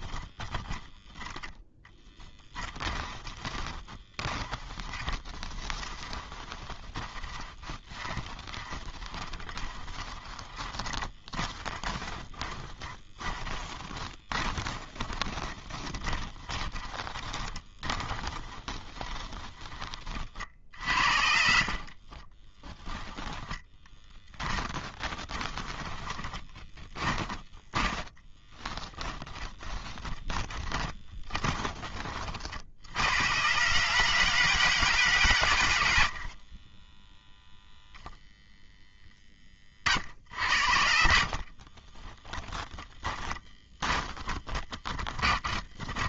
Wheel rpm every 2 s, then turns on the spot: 10, 20, 10, 20, 20, 20, 20, 20, 20, 20, 40, 10, 20, 20, 10, 30, 130, 110, 0, 20, 40, 10, 20.
2-18 20-32 42-46